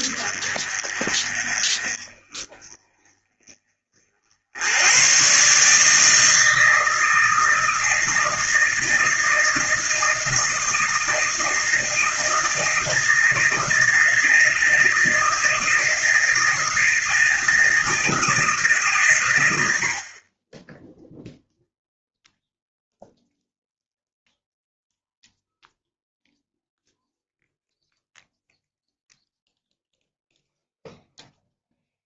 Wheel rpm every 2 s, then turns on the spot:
20, 20, 90, 160, 160, 160, 160, 160, 160, 140, 10, 0, 0, 0, 0, 0.
none